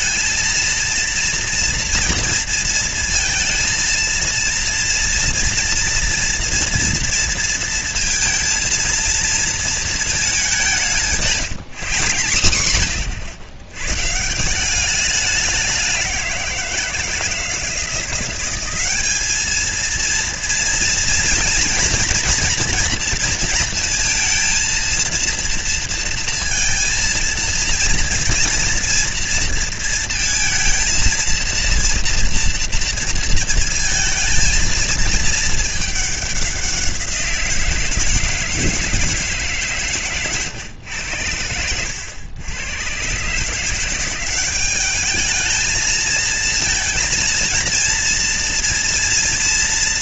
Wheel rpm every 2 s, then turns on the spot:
230, 230, 230, 230, 230, 190, 110, 170, 180, 190, 230, 230, 230, 230, 230, 230, 230, 230, 190, 160, 120, 100, 190, 220, 230.
none